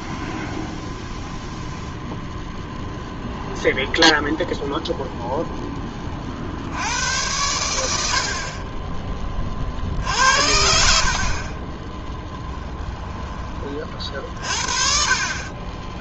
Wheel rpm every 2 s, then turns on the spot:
0, 0, 0, 80, 20, 60, 10, 40.
12-14